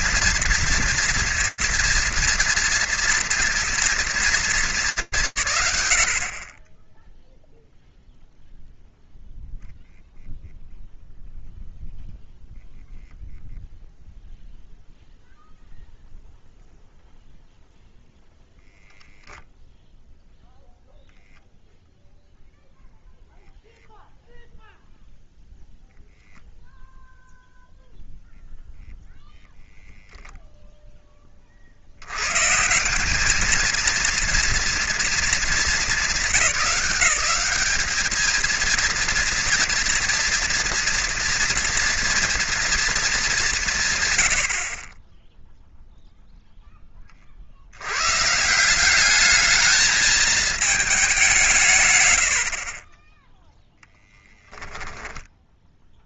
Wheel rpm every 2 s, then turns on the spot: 230, 230, 180, 10, 0, 0, 0, 0, 0, 0, 0, 0, 0, 0, 0, 10, 190, 230, 180, 230, 240, 210, 20, 20, 190, 210, 40, 10.
54-56